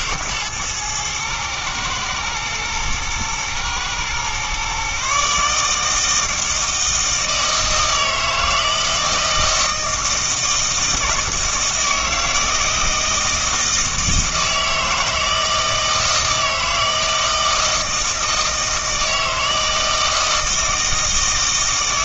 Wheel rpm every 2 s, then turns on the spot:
120, 110, 130, 160, 160, 160, 160, 160, 160, 160, 160.
none